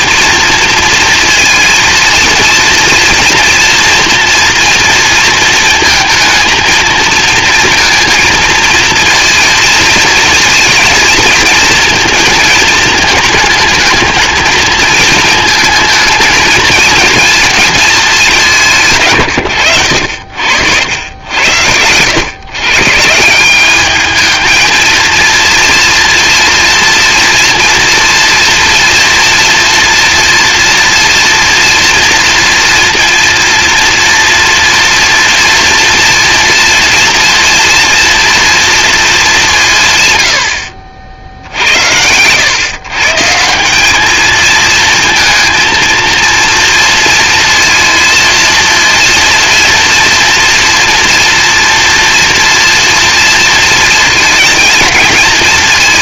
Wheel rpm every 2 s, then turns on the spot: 230, 230, 230, 230, 230, 230, 220, 220, 230, 140, 90, 140, 230, 230, 230, 230, 230, 230, 230, 220, 60, 130, 230, 230, 230, 230, 230, 220.
none